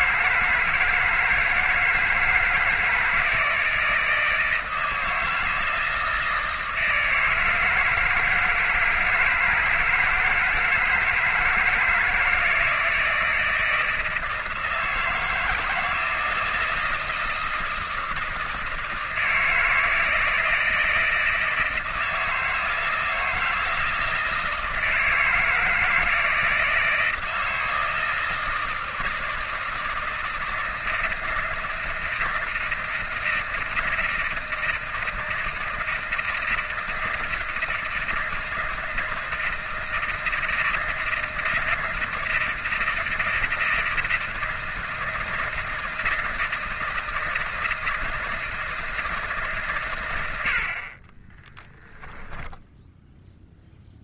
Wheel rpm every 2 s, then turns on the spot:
160, 160, 160, 160, 160, 160, 160, 160, 160, 160, 160, 160, 160, 160, 160, 160, 170, 160, 160, 160, 160, 160, 160, 170, 160, 70, 10.
52-54